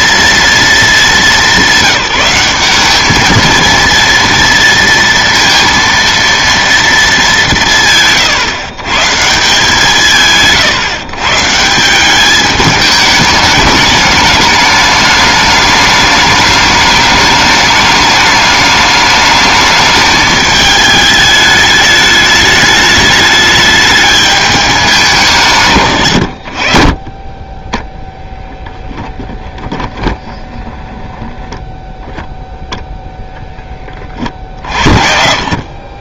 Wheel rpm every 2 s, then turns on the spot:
230, 190, 230, 230, 130, 150, 210, 210, 210, 210, 210, 210, 210, 70, 0, 10, 0, 50.
30-32